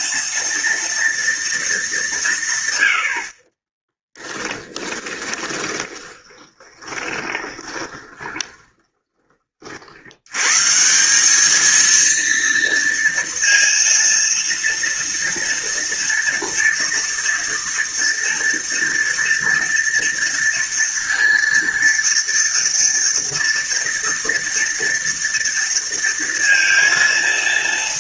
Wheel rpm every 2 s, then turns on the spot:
230, 100, 20, 20, 20, 150, 230, 230, 230, 230, 230, 230, 230, 230.
4-10